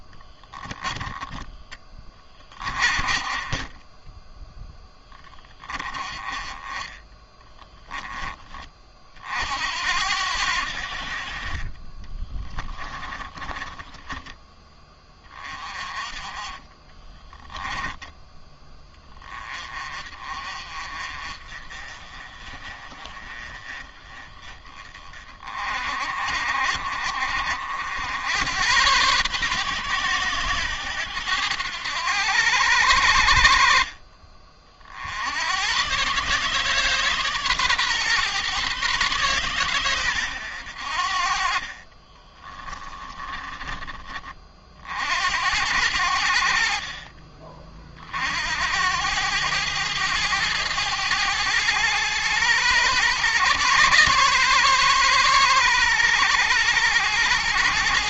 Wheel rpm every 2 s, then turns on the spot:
10, 30, 20, 20, 40, 70, 30, 20, 20, 10, 40, 40, 30, 50, 110, 100, 70, 60, 140, 130, 80, 30, 60, 40, 90, 100, 110, 120, 100.
12-14 16-18 42-44 46-48